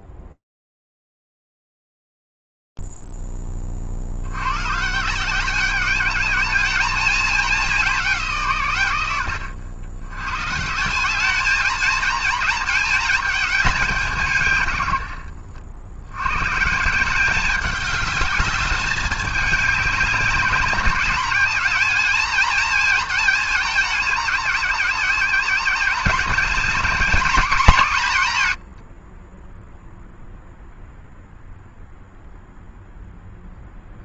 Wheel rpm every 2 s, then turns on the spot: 0, 0, 20, 190, 210, 100, 210, 210, 70, 200, 210, 210, 210, 200, 190, 0, 0.
none